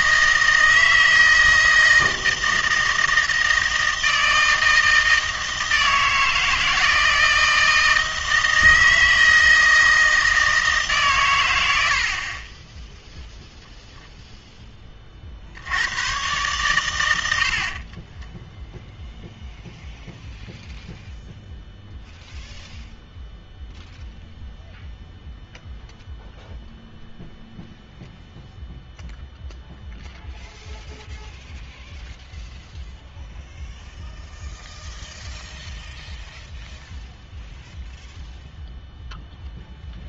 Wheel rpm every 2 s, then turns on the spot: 160, 160, 160, 160, 160, 160, 20, 20, 110, 0, 0, 0, 0, 0, 0, 0, 0, 0, 0, 0.
none